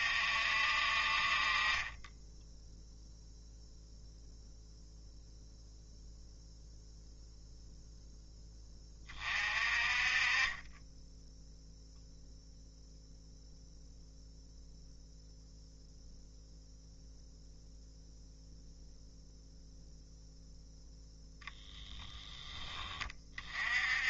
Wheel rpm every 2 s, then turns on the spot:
50, 0, 0, 0, 30, 20, 0, 0, 0, 0, 0, 20.
none